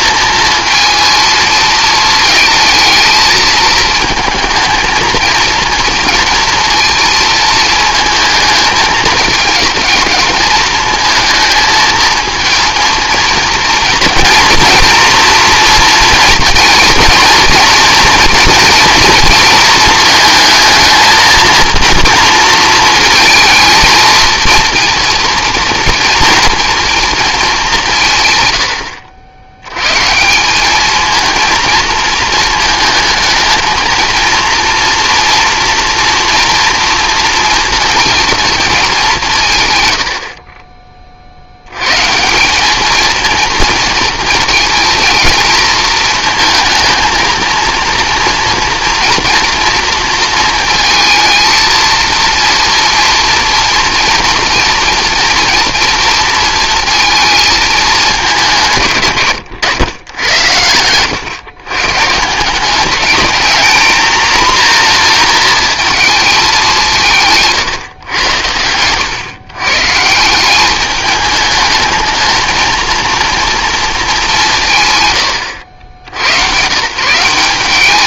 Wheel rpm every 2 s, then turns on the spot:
230, 220, 230, 230, 220, 220, 230, 230, 230, 230, 220, 230, 230, 230, 90, 210, 220, 230, 230, 220, 30, 210, 230, 220, 240, 220, 240, 240, 230, 160, 100, 190, 230, 180, 110, 200, 220, 150, 140.
68-70